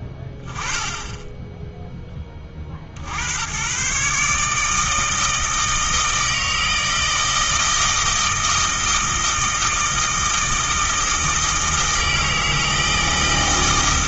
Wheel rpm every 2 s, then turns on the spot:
10, 40, 150, 160, 160, 160, 160.
none